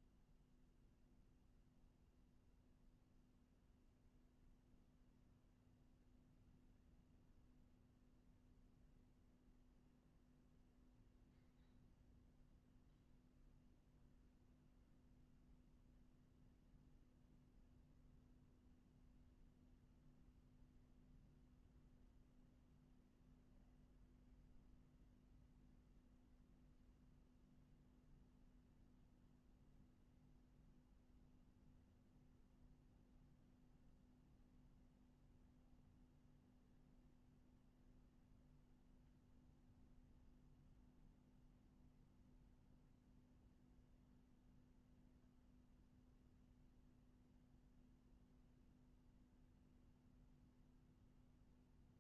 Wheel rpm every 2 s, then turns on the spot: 0, 0, 0, 0, 0, 0, 0, 0, 0, 0, 0, 0, 0, 0, 0, 0, 0, 0, 0, 0, 0, 0, 0, 0, 0, 0.
none